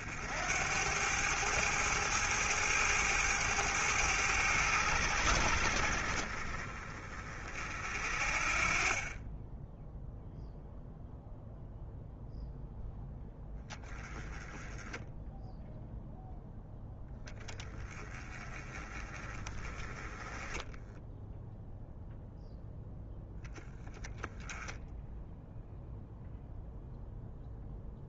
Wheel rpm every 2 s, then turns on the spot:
90, 110, 80, 40, 30, 0, 0, 10, 10, 40, 10, 0, 0, 0.
20-22